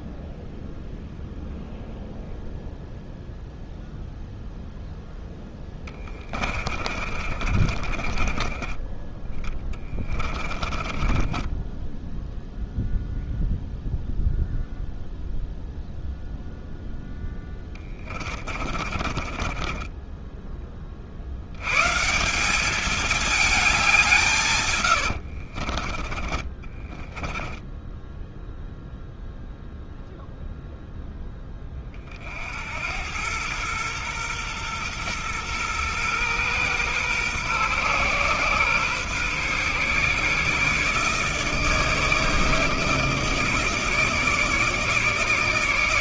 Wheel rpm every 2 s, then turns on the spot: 0, 0, 0, 30, 20, 30, 0, 0, 0, 30, 10, 170, 140, 20, 0, 0, 60, 120, 120, 130, 140, 160, 160.
6-12 18-20 26-28